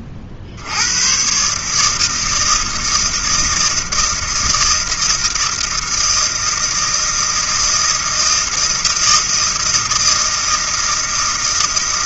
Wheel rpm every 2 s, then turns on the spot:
70, 160, 160, 160, 160, 160.
none